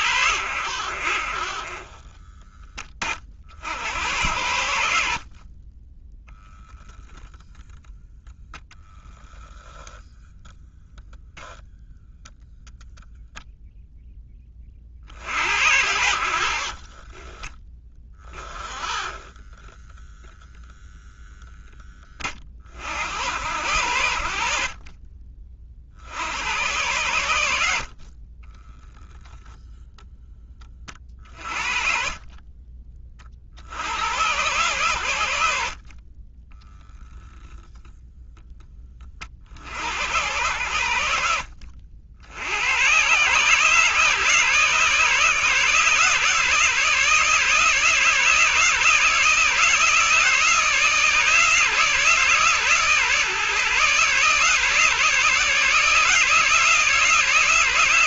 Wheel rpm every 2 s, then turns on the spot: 60, 30, 60, 0, 0, 0, 0, 50, 30, 20, 0, 70, 40, 100, 10, 30, 40, 110, 0, 30, 80, 120, 140, 150, 160, 160, 140, 150, 160.
30-32